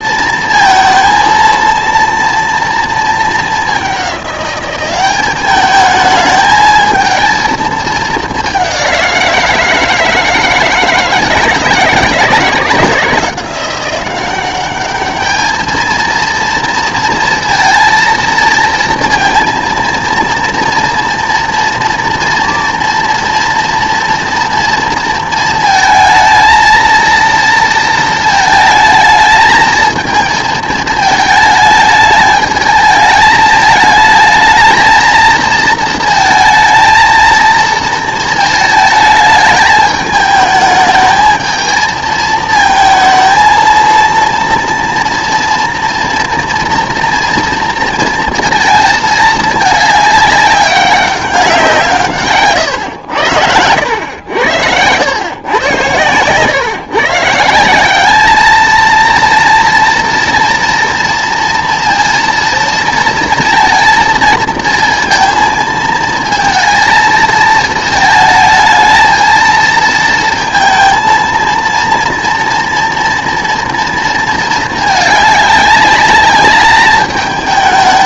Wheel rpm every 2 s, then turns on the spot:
230, 230, 190, 220, 200, 160, 160, 200, 230, 230, 230, 230, 230, 230, 220, 220, 220, 220, 220, 220, 210, 220, 230, 240, 220, 200, 120, 80, 130, 220, 230, 230, 230, 220, 220, 230, 240, 220, 210.
52-54